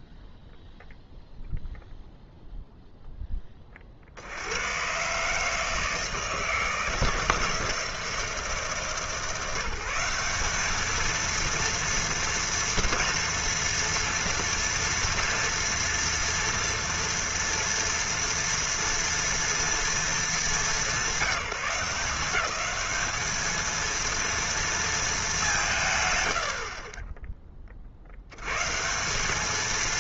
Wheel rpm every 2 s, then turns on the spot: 0, 0, 110, 160, 150, 220, 230, 240, 230, 230, 180, 210, 190, 20, 210.
none